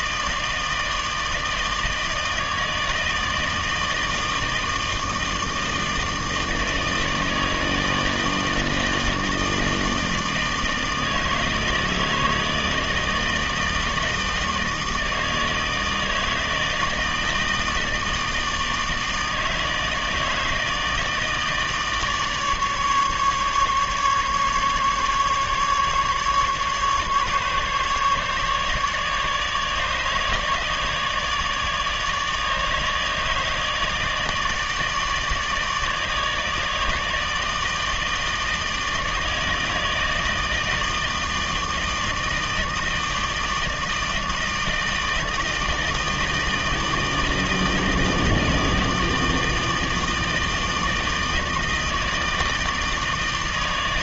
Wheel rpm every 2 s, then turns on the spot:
160, 160, 160, 160, 160, 160, 160, 160, 160, 160, 160, 150, 150, 140, 150, 150, 150, 150, 150, 160, 160, 160, 160, 160, 160, 160, 160.
none